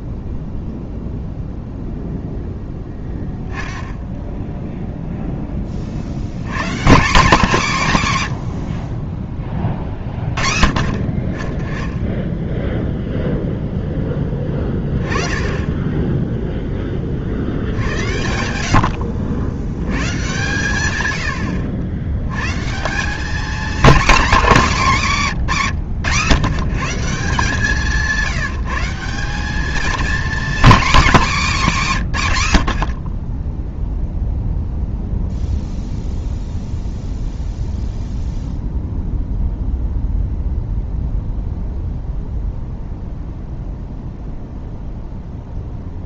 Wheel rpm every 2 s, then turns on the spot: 0, 10, 0, 150, 110, 30, 0, 10, 10, 50, 120, 160, 210, 160, 170, 240, 70, 0, 0, 0, 0, 0, 0.
none